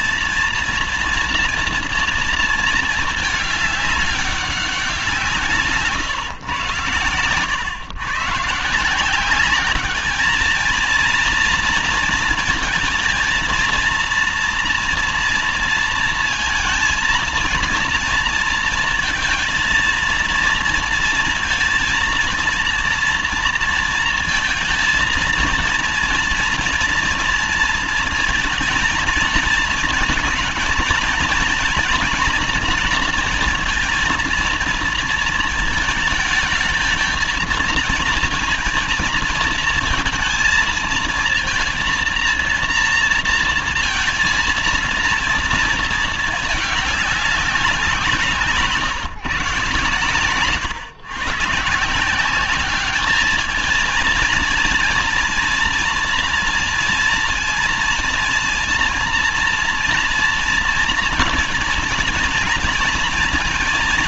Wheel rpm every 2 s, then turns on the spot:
230, 220, 200, 130, 150, 220, 230, 230, 230, 230, 230, 230, 230, 230, 230, 230, 230, 230, 220, 230, 230, 230, 230, 210, 150, 130, 200, 230, 230, 230, 240, 230.
none